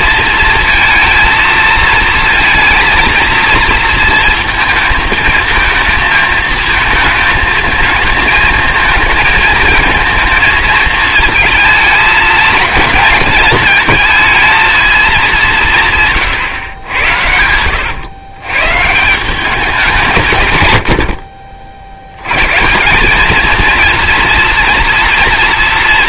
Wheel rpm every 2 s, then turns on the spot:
230, 230, 220, 220, 220, 230, 220, 220, 110, 130, 110, 140, 240.
none